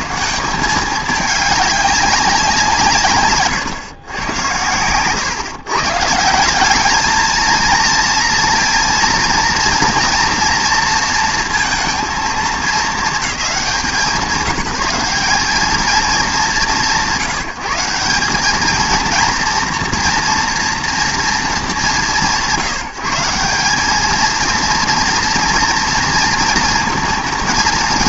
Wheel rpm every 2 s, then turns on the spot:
190, 160, 110, 210, 230, 230, 220, 180, 160, 210, 240, 170, 230, 230.
4-6